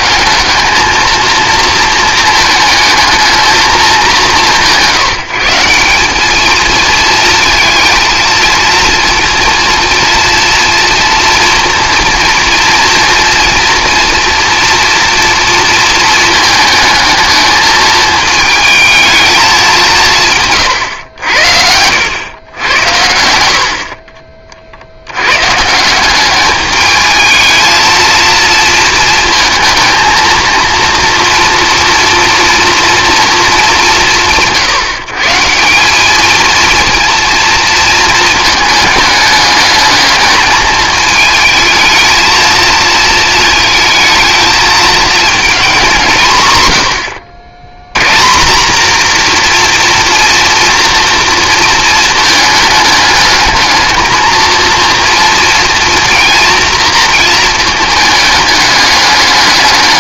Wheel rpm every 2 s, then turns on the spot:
210, 220, 170, 230, 230, 230, 230, 240, 220, 220, 130, 100, 70, 210, 230, 230, 230, 150, 230, 210, 210, 220, 220, 100, 220, 230, 210, 230, 230, 210.
none